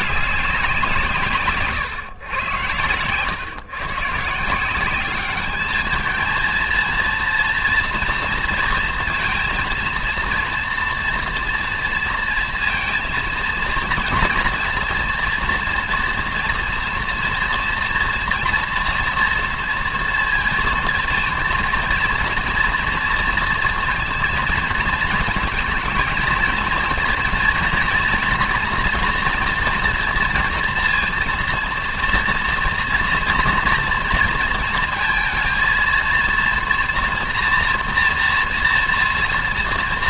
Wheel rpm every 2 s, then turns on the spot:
180, 120, 180, 230, 230, 230, 230, 230, 240, 230, 230, 230, 230, 230, 240, 230, 230, 230, 230, 230.
none